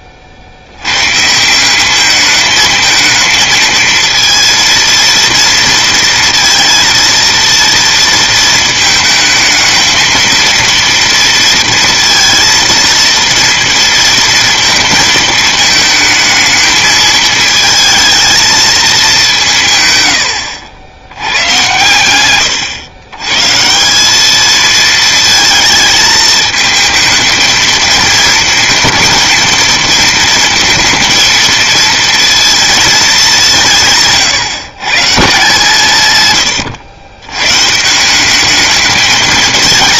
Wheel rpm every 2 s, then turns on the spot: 80, 220, 230, 230, 220, 230, 230, 230, 220, 220, 80, 120, 220, 220, 230, 230, 230, 130, 120, 210.
none